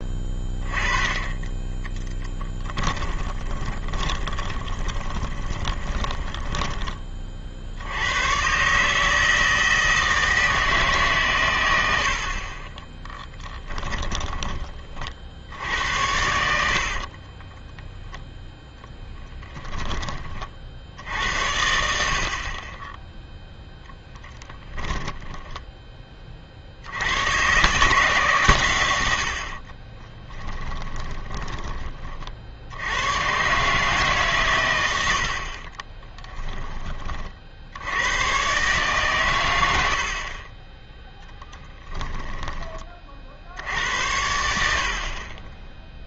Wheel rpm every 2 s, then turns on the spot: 20, 10, 20, 20, 130, 150, 20, 30, 40, 0, 60, 30, 10, 60, 120, 10, 60, 110, 20, 140, 30, 10, 80.
2-8 12-14 16-18 30-32